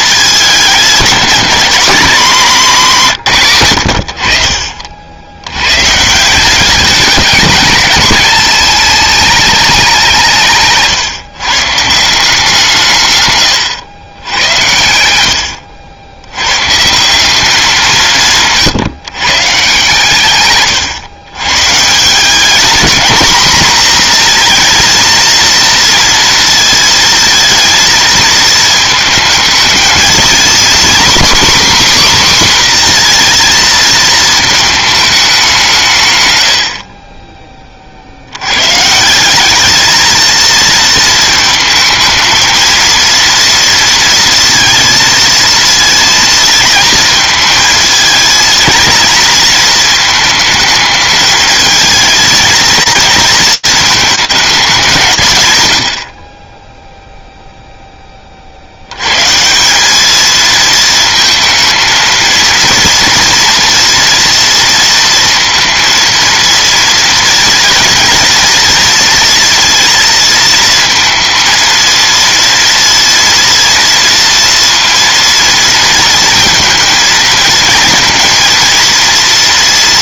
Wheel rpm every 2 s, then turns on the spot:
210, 200, 60, 200, 210, 150, 160, 90, 150, 160, 130, 230, 230, 220, 220, 260, 250, 220, 40, 140, 230, 230, 230, 230, 230, 220, 230, 200, 0, 60, 220, 230, 230, 230, 230, 230, 230, 230, 230, 230.
10-12